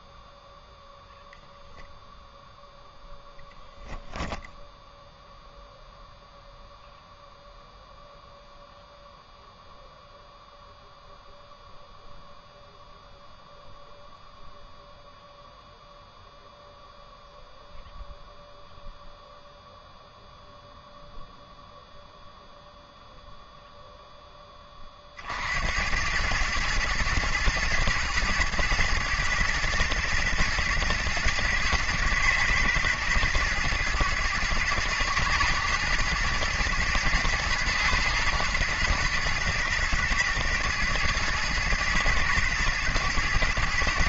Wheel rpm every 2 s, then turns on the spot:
10, 0, 0, 0, 0, 0, 0, 0, 0, 0, 0, 0, 20, 110, 120, 120, 110, 110, 110, 110, 110, 120.
none